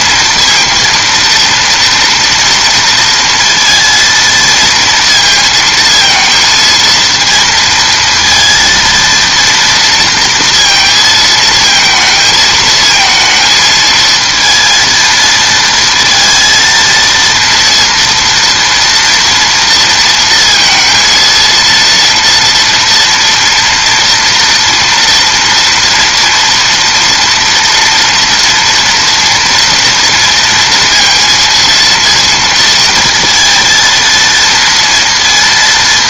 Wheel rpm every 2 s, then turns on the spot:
230, 230, 230, 230, 230, 230, 220, 230, 230, 230, 230, 230, 230, 230, 230, 230, 230, 230.
none